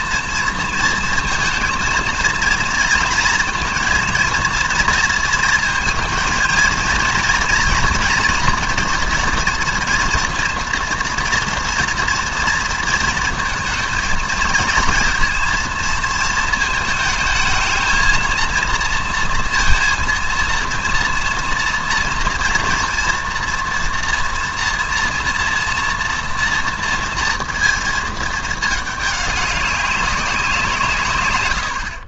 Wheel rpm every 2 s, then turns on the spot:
230, 230, 230, 230, 230, 230, 230, 230, 220, 230, 230, 230, 230, 230, 210, 160.
none